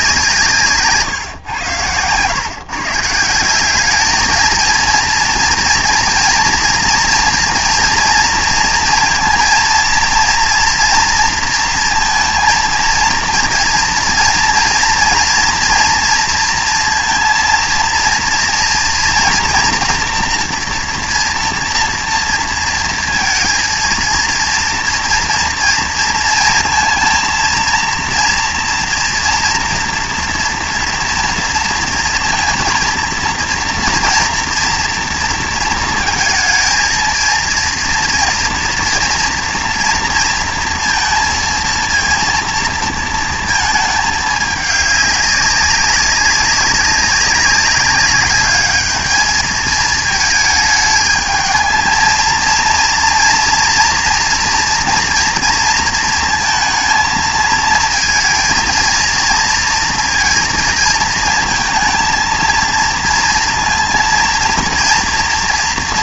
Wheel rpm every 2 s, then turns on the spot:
140, 150, 230, 230, 230, 230, 230, 230, 230, 240, 240, 230, 230, 230, 230, 230, 230, 230, 230, 230, 230, 230, 210, 190, 210, 220, 230, 230, 220, 230, 220, 230, 230.
none